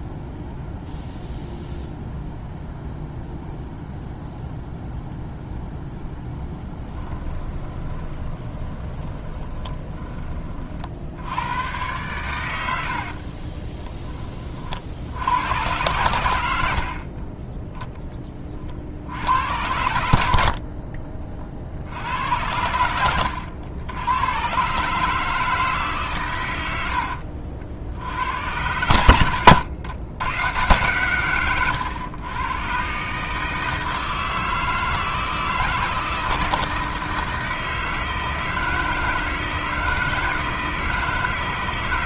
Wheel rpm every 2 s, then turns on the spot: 0, 0, 0, 20, 20, 40, 80, 50, 60, 50, 60, 90, 130, 90, 100, 120, 120, 160, 160, 160, 160.
6-10 12-14 20-24